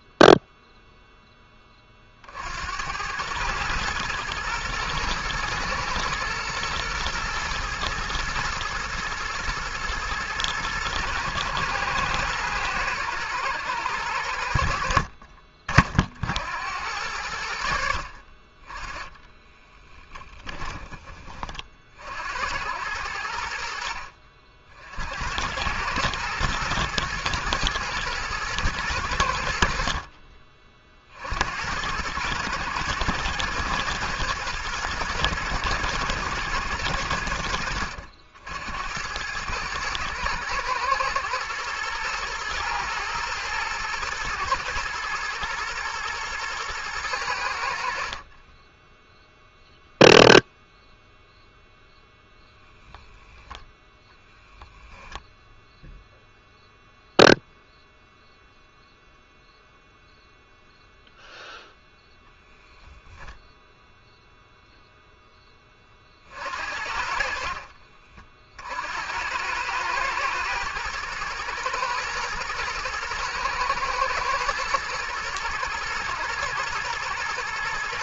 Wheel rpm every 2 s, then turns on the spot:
0, 80, 120, 120, 110, 110, 110, 70, 80, 20, 10, 80, 60, 110, 110, 40, 110, 110, 100, 80, 110, 120, 110, 110, 20, 0, 0, 0, 0, 0, 0, 10, 0, 50, 60, 110, 110, 110, 110.
48-50